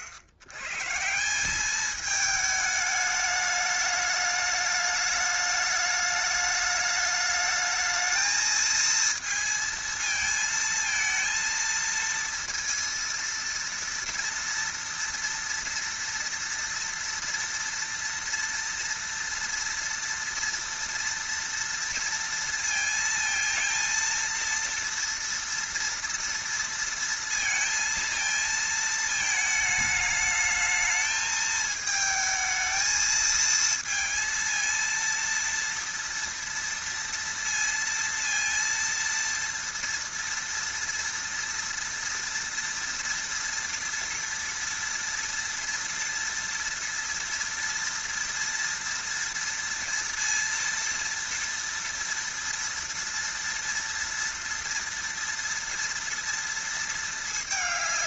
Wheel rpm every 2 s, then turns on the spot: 90, 210, 210, 210, 220, 220, 230, 230, 230, 230, 230, 230, 230, 230, 220, 220, 220, 230, 230, 230, 230, 230, 230, 230, 230, 230, 230, 230, 230.
none